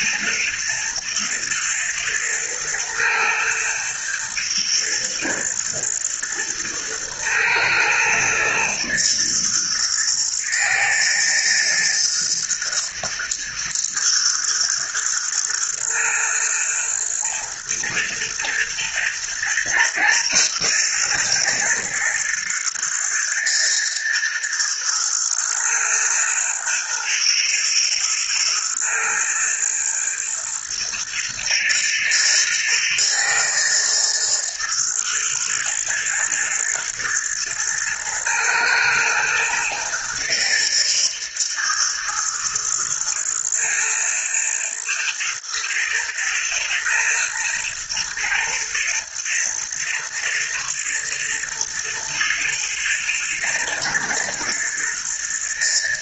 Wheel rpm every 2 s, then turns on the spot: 120, 110, 110, 110, 120, 110, 120, 110, 110, 110, 110, 120, 120, 120, 110, 110, 120, 120, 120, 120, 110, 110, 120, 110, 110, 110, 120, 120.
none